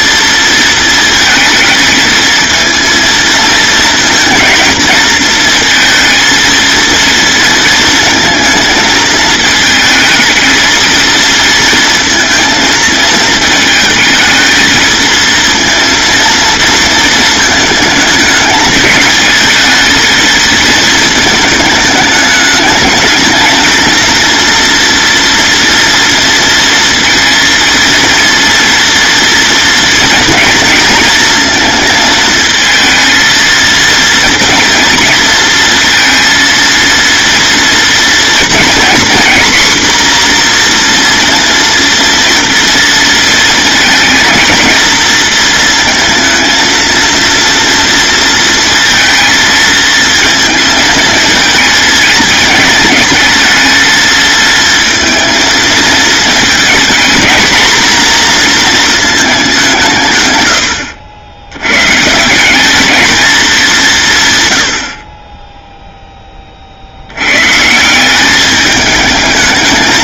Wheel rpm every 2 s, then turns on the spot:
230, 230, 230, 230, 220, 230, 220, 230, 220, 210, 220, 220, 230, 230, 230, 230, 230, 230, 230, 250, 240, 220, 230, 230, 220, 220, 220, 230, 220, 220, 70, 210, 50, 70, 210.
none